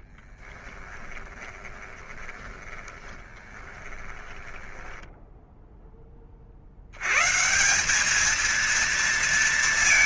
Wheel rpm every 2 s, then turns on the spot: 30, 20, 20, 20, 200.
0-6